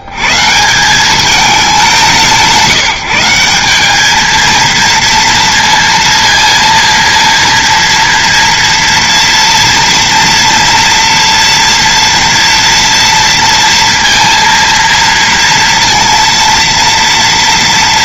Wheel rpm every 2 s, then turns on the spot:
150, 170, 230, 230, 240, 230, 240, 230, 230.
none